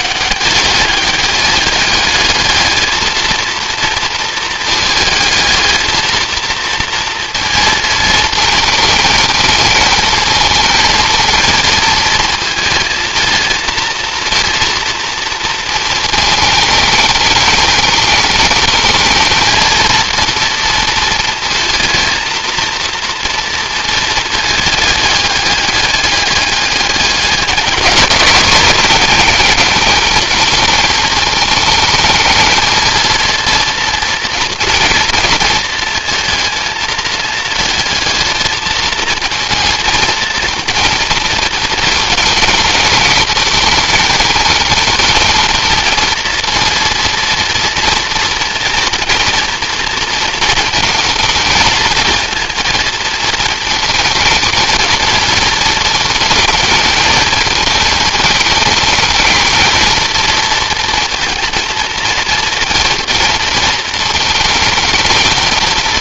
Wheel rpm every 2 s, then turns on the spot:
210, 220, 220, 230, 220, 230, 220, 230, 220, 230, 220, 230, 210, 200, 210, 220, 230, 230, 220, 220, 230, 220, 220, 230, 230, 220, 230, 220, 220, 230, 220, 230, 220.
none